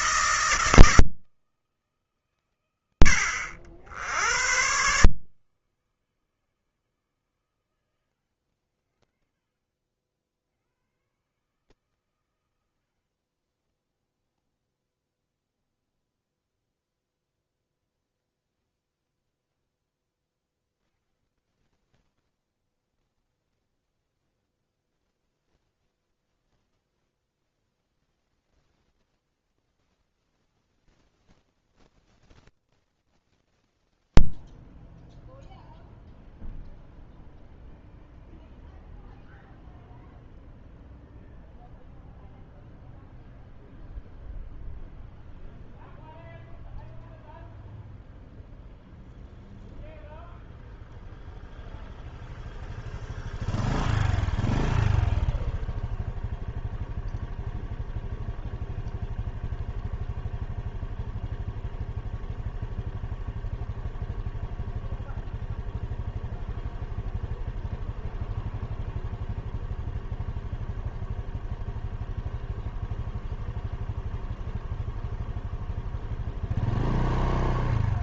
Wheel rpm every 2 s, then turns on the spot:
160, 80, 140, 140, 50, 120, 60, 10, 0, 0, 10, 30, 0, 0, 0, 0, 0, 0, 0, 0, 0, 0, 0, 0, 0, 0, 0, 0, 0, 0, 0, 0, 0, 0, 0, 0, 0, 0, 0.
12-16 22-24